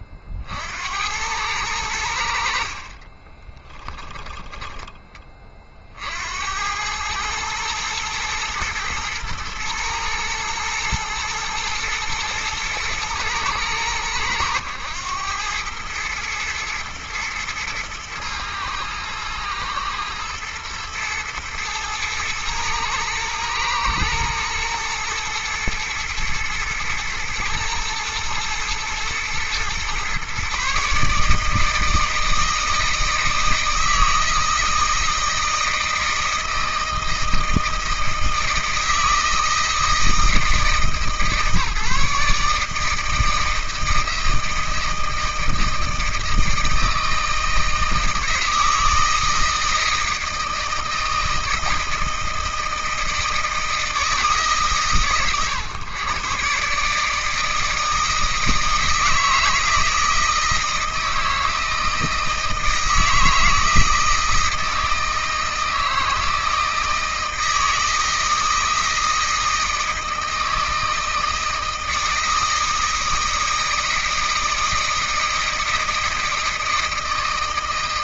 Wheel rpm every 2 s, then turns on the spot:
80, 40, 20, 100, 110, 120, 120, 100, 110, 110, 110, 120, 110, 120, 120, 150, 160, 160, 160, 160, 160, 160, 160, 160, 160, 160, 160, 120, 140, 160, 160, 160, 160, 160, 160, 160, 160, 160, 160.
2-4